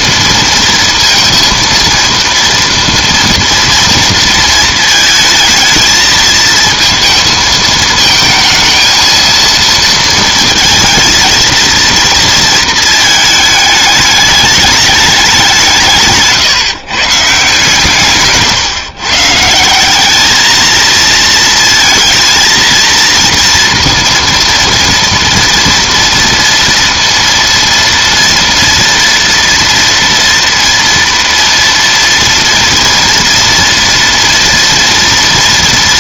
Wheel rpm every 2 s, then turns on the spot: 230, 230, 220, 230, 230, 230, 220, 210, 150, 140, 230, 230, 230, 230, 230, 230, 230, 230.
none